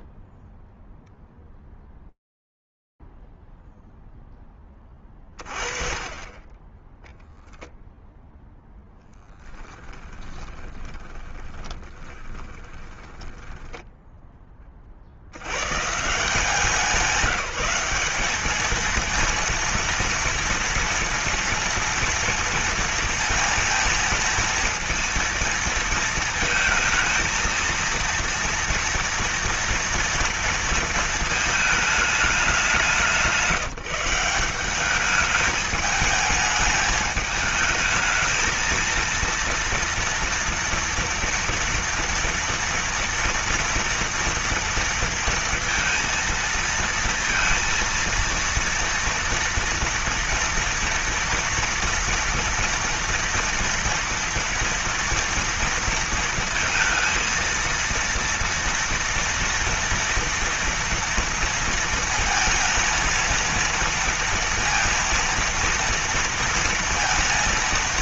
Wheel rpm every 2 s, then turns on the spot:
0, 0, 10, 20, 0, 20, 20, 60, 180, 230, 240, 230, 230, 220, 230, 230, 180, 200, 210, 230, 230, 230, 230, 230, 230, 230, 230, 230, 230, 230, 230, 230, 230, 230.
10-14